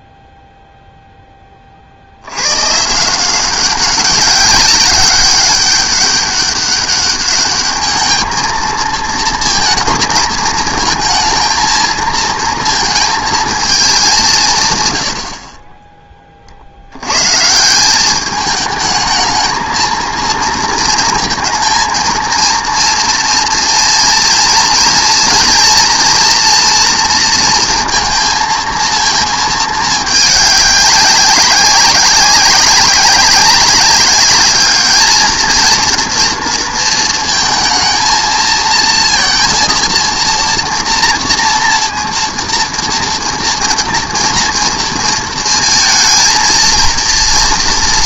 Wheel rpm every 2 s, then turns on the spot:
40, 190, 200, 210, 230, 230, 210, 20, 170, 230, 230, 230, 230, 230, 220, 190, 200, 230, 230, 230, 230, 230, 230, 230.
none